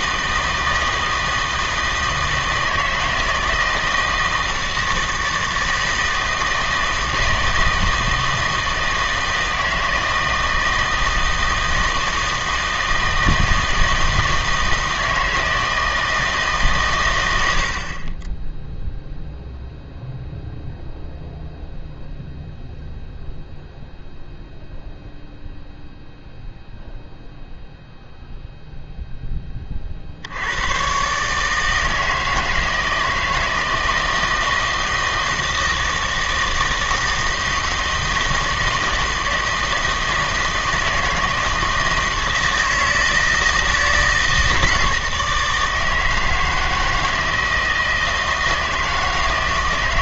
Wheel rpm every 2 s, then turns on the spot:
160, 160, 160, 160, 160, 160, 160, 160, 140, 10, 0, 0, 0, 0, 0, 110, 160, 160, 160, 160, 160, 160, 160, 160, 160.
none